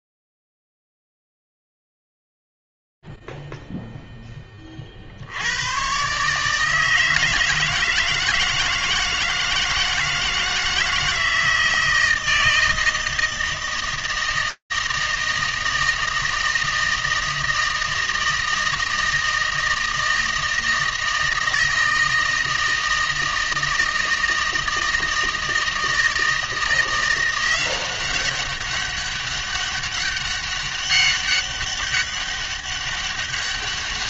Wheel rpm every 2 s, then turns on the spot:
0, 0, 0, 120, 160, 160, 160, 160, 160, 160, 160, 160, 160, 160, 190, 200, 200.
none